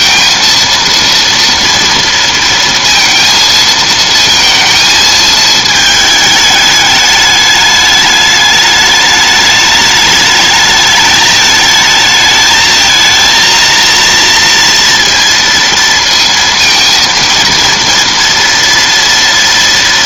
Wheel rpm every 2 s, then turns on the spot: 230, 230, 220, 210, 210, 210, 220, 230, 220, 230.
none